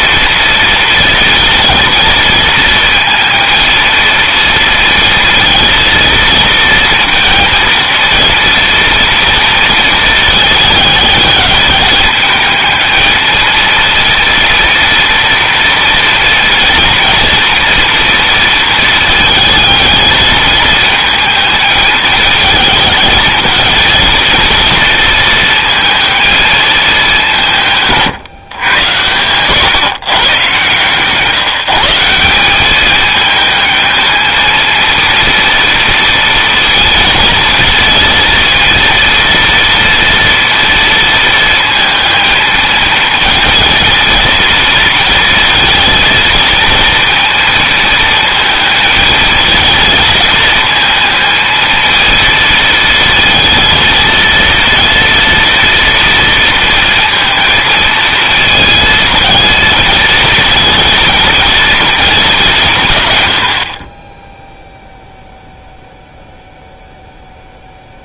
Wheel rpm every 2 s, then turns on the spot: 230, 230, 230, 230, 240, 220, 220, 230, 230, 230, 220, 220, 230, 210, 120, 140, 200, 230, 230, 230, 230, 220, 230, 220, 220, 220, 230, 230, 230, 230, 220, 150, 0, 0.
none